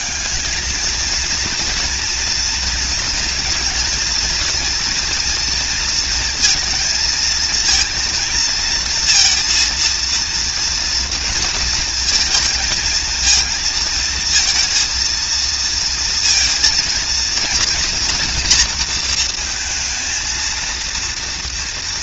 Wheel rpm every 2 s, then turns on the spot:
210, 230, 230, 230, 230, 240, 230, 230, 230, 230, 230.
none